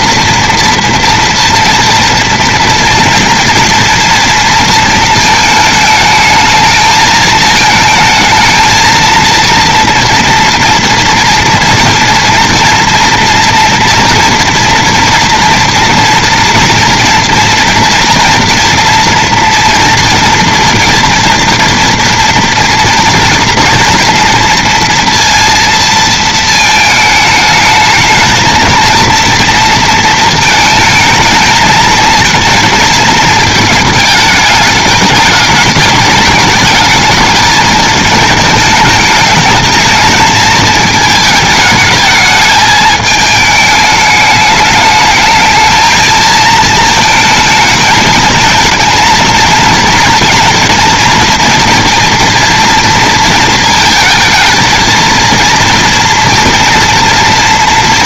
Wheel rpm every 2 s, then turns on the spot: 230, 230, 220, 220, 230, 240, 230, 230, 230, 240, 230, 240, 230, 220, 230, 220, 230, 210, 210, 210, 220, 220, 210, 220, 220, 240, 230, 230, 230.
none